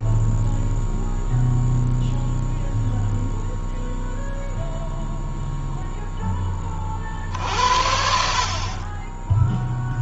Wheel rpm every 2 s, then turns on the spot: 0, 0, 0, 50, 30.
none